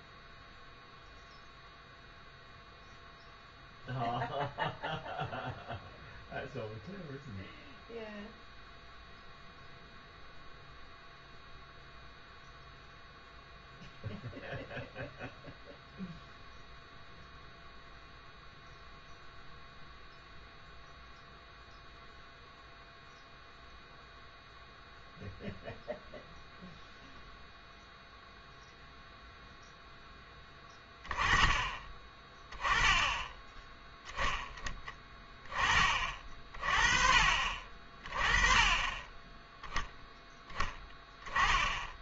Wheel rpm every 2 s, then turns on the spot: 0, 0, 0, 0, 0, 0, 0, 0, 0, 0, 0, 0, 0, 0, 0, 10, 10, 10, 40, 20, 10.
none